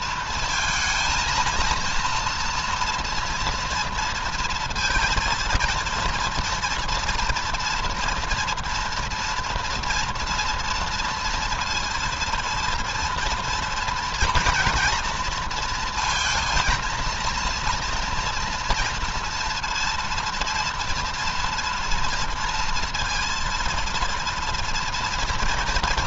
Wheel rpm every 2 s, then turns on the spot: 230, 230, 230, 230, 230, 230, 230, 230, 230, 230, 230, 230, 230.
none